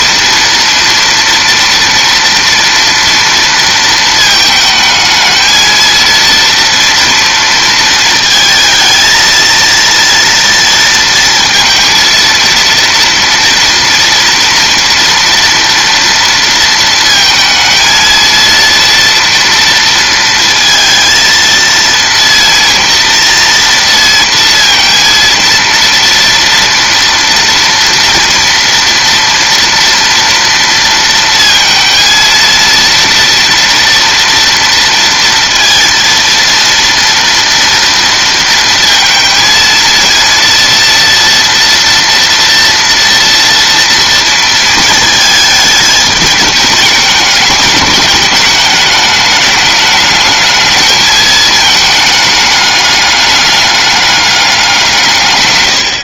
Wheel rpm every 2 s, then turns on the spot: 230, 230, 220, 230, 220, 230, 230, 230, 230, 230, 230, 230, 230, 230, 230, 230, 230, 230, 230, 230, 240, 230, 220, 210, 210, 220, 210, 160.
none